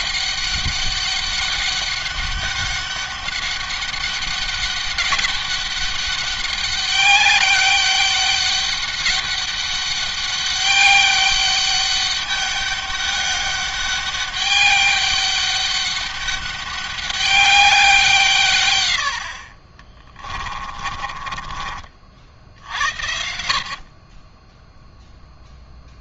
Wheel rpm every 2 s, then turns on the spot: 200, 200, 200, 200, 200, 200, 200, 200, 200, 90, 30, 70, 0.
20-22